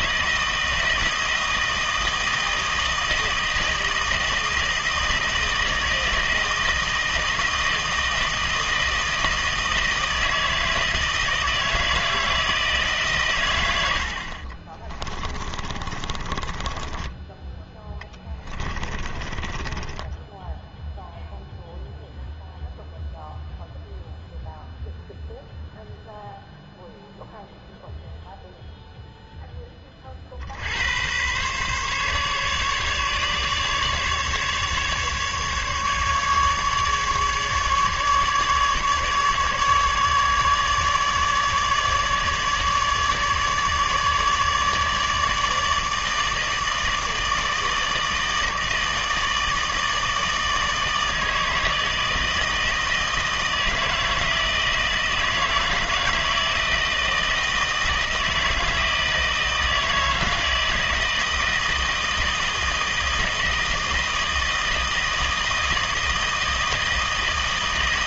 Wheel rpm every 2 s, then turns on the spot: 160, 160, 160, 160, 160, 160, 160, 40, 20, 30, 0, 0, 0, 0, 0, 80, 140, 150, 150, 150, 150, 150, 150, 160, 150, 160, 160, 160, 160, 160, 160, 160, 160, 160.
14-20